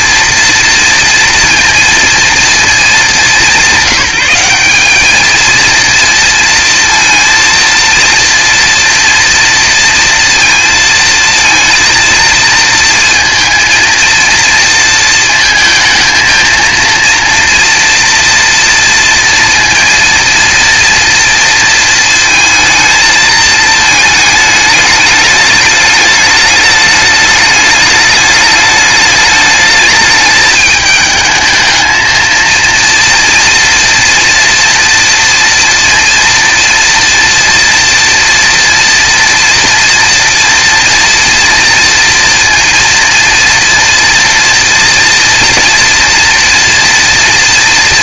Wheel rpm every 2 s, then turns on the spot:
230, 220, 200, 230, 230, 230, 230, 230, 230, 230, 230, 230, 210, 210, 210, 210, 230, 230, 240, 230, 230, 230, 230, 230.
none